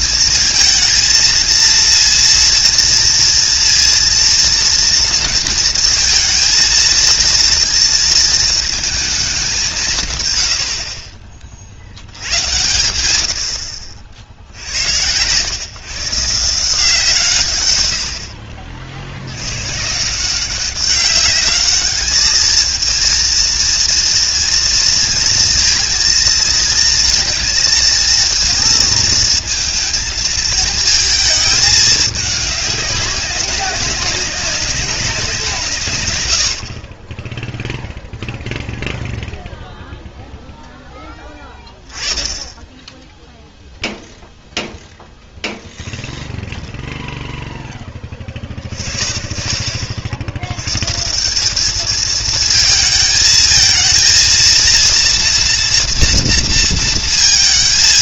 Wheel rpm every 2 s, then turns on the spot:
230, 230, 230, 230, 220, 70, 100, 80, 160, 60, 190, 220, 230, 230, 230, 220, 200, 190, 60, 0, 10, 10, 0, 0, 40, 120, 220, 230, 230.
none